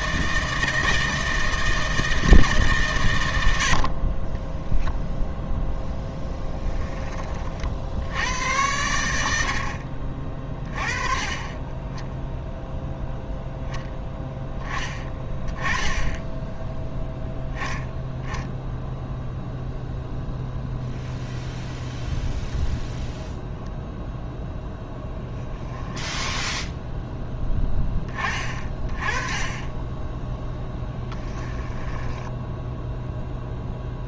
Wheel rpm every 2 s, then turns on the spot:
160, 150, 10, 10, 90, 30, 0, 10, 10, 10, 0, 0, 10, 10, 20, 10, 0.
4-6 26-28